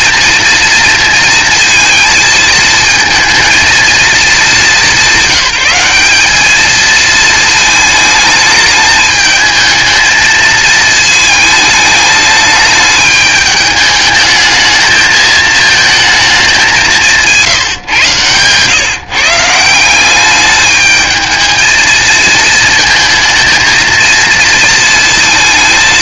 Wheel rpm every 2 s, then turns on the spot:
230, 220, 200, 210, 210, 220, 210, 210, 200, 130, 210, 230, 230.
none